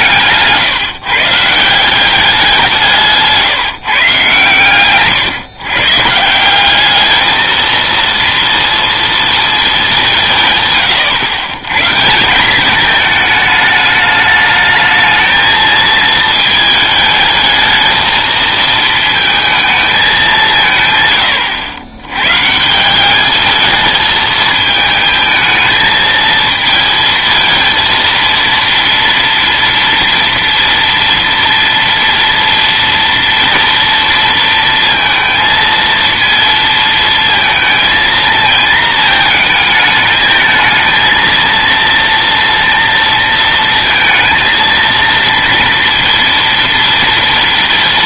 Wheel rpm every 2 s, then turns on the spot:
160, 180, 130, 190, 230, 130, 210, 220, 220, 220, 140, 160, 220, 220, 230, 240, 230, 230, 230, 230, 220, 230, 230, 230.
none